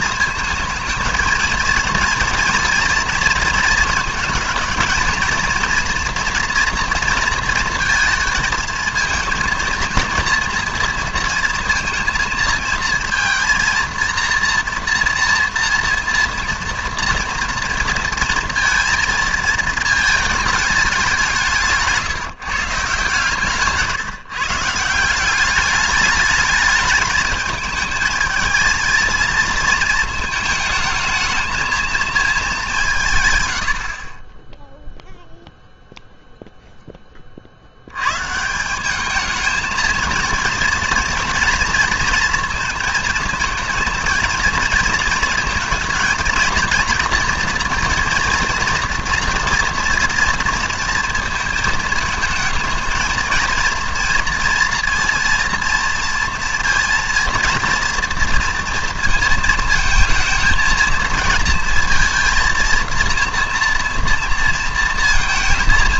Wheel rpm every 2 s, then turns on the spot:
220, 230, 220, 230, 220, 230, 230, 230, 230, 220, 200, 160, 150, 210, 220, 220, 190, 0, 0, 180, 230, 230, 230, 230, 230, 230, 220, 230, 230, 230, 220, 230, 230.
none